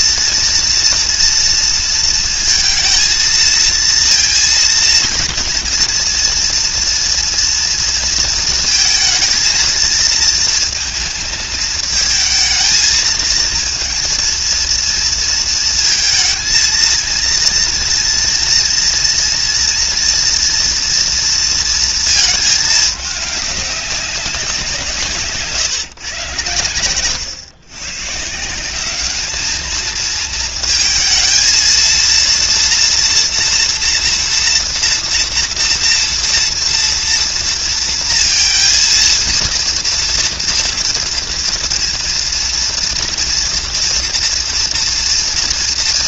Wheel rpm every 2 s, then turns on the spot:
230, 230, 230, 230, 230, 230, 220, 230, 230, 230, 230, 210, 180, 110, 180, 230, 230, 230, 230, 230, 230, 230, 230.
none